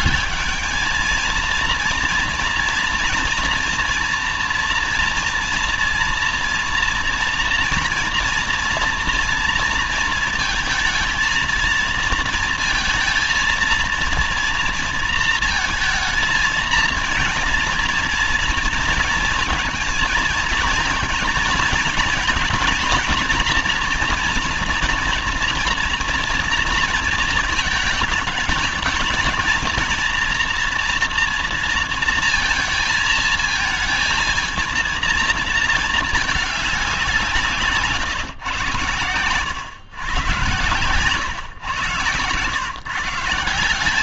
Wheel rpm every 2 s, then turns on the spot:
210, 230, 230, 230, 230, 230, 230, 230, 230, 230, 230, 230, 240, 230, 220, 240, 230, 230, 210, 120, 120, 120.
none